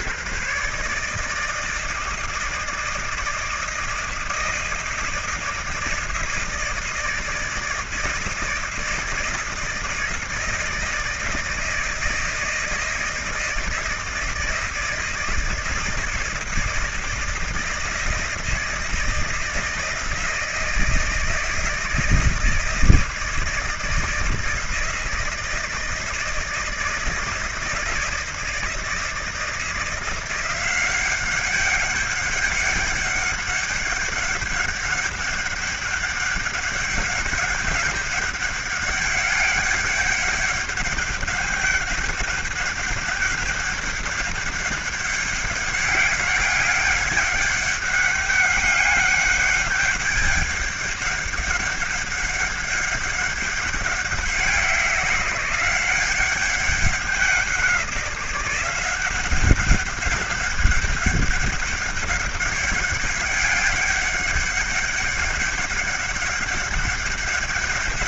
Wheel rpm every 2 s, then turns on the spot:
140, 160, 160, 160, 160, 160, 160, 160, 160, 160, 160, 160, 170, 170, 160, 180, 200, 200, 200, 200, 200, 200, 200, 200, 200, 200, 200, 190, 190, 180, 200, 200, 200, 200.
none